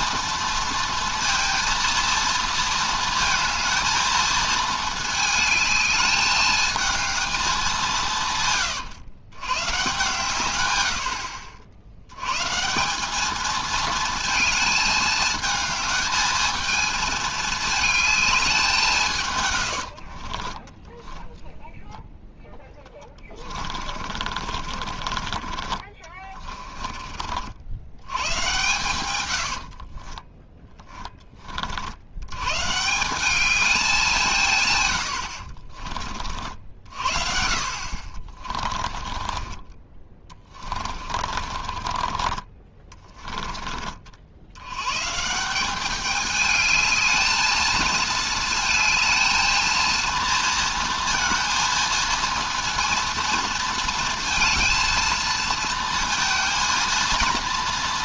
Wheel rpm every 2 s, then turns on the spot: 230, 230, 220, 220, 130, 100, 150, 220, 220, 190, 20, 10, 40, 30, 120, 10, 140, 130, 60, 30, 30, 20, 110, 210, 220, 230, 230, 230, 230.
20-28 38-44